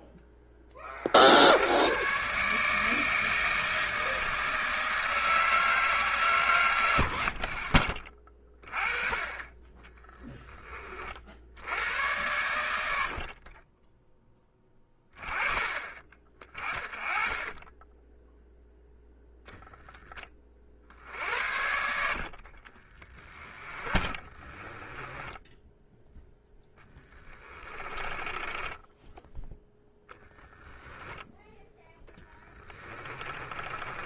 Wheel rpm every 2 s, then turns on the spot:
30, 160, 160, 80, 30, 30, 70, 10, 20, 0, 50, 30, 20, 10, 10, 10, 30.
6-8 22-30 32-34